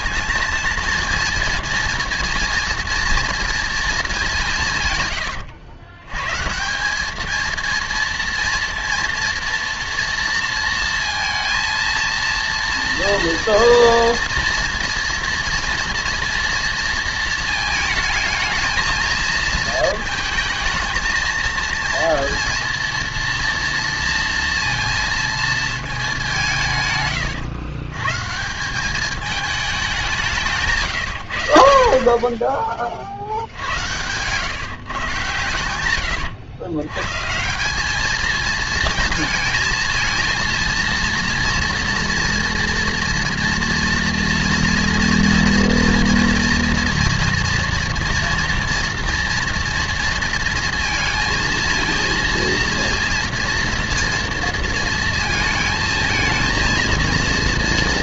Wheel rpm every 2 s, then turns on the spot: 220, 230, 160, 170, 230, 230, 230, 230, 230, 220, 220, 230, 230, 160, 180, 150, 30, 130, 120, 220, 230, 240, 240, 230, 230, 230, 230, 230, 230.
30-32